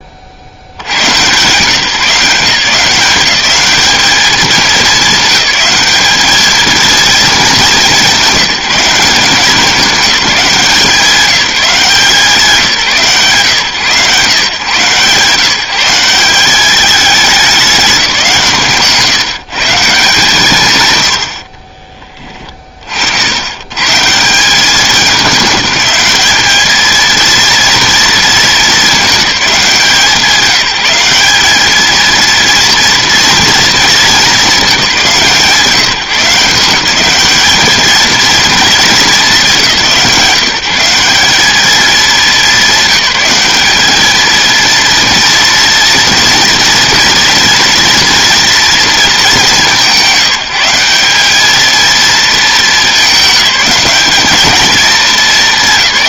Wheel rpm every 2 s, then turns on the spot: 120, 190, 200, 230, 190, 180, 140, 130, 210, 150, 100, 50, 200, 230, 210, 190, 230, 180, 190, 210, 190, 200, 230, 230, 220, 190, 220, 220.
none